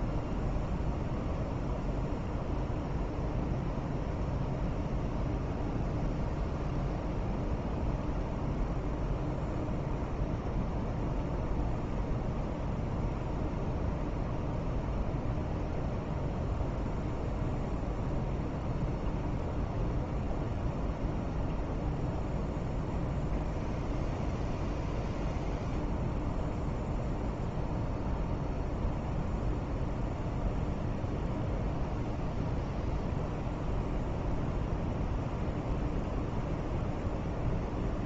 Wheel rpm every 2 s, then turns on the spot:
0, 0, 0, 0, 0, 0, 0, 0, 0, 0, 0, 0, 0, 0, 0, 0, 0, 0, 0.
none